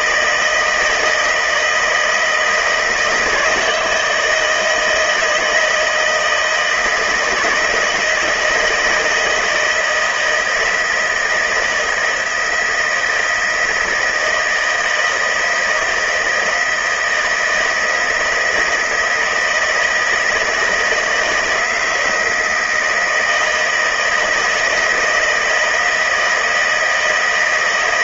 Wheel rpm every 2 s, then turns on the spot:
160, 160, 160, 160, 170, 160, 160, 160, 160, 160, 160, 160, 160, 160.
none